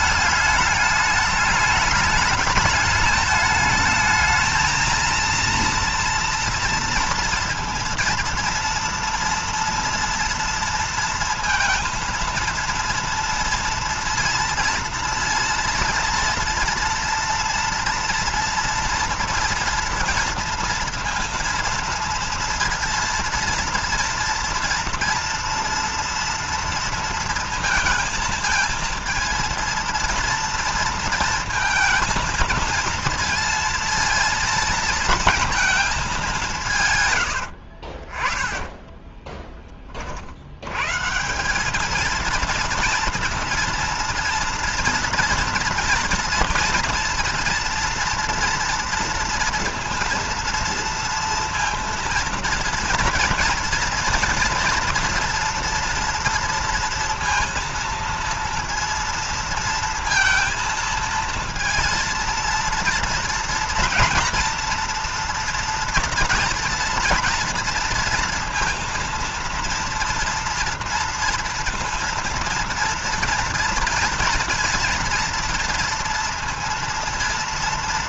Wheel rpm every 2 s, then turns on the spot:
210, 210, 220, 230, 230, 230, 230, 240, 230, 230, 230, 230, 230, 230, 220, 230, 230, 230, 160, 20, 90, 230, 230, 230, 230, 230, 230, 230, 230, 230, 230, 230, 240, 230, 230, 230, 230, 230, 230.
38-40